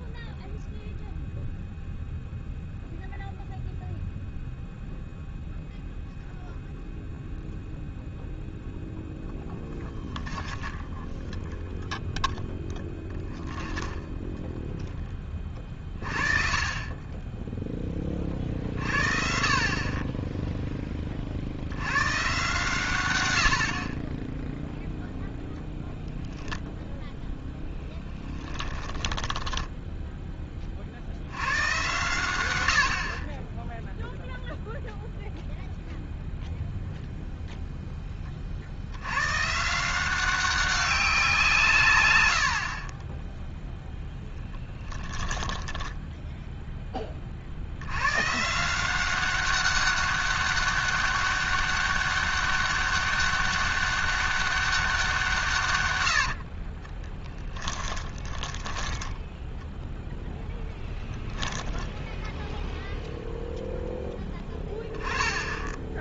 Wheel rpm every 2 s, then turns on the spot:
0, 0, 0, 0, 10, 0, 0, 30, 20, 30, 110, 30, 0, 10, 10, 120, 0, 0, 0, 160, 150, 0, 10, 70, 190, 200, 200, 160, 10, 0, 10, 0, 10.
8-10 26-30 44-46 56-58